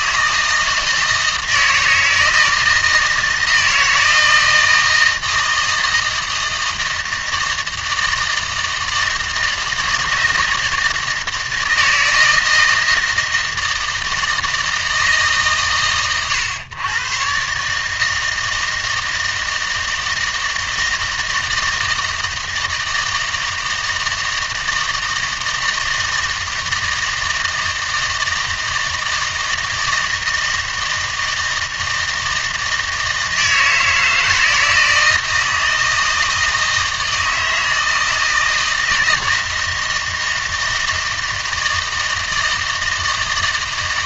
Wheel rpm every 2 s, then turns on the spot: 160, 160, 160, 160, 160, 160, 160, 160, 110, 160, 160, 160, 160, 160, 160, 160, 160, 160, 160, 160, 160, 160.
none